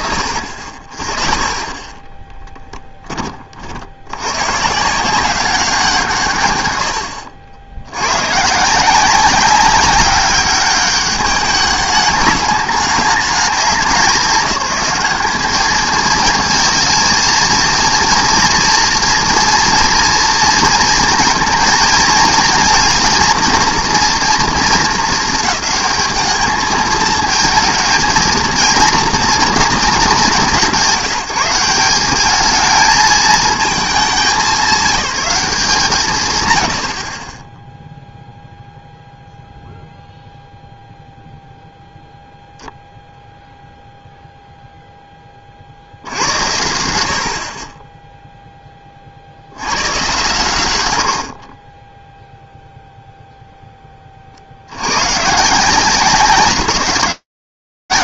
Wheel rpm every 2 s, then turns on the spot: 40, 10, 150, 100, 160, 200, 200, 200, 220, 230, 230, 230, 230, 220, 230, 170, 210, 190, 100, 0, 0, 0, 0, 70, 10, 110, 0, 60, 180.
none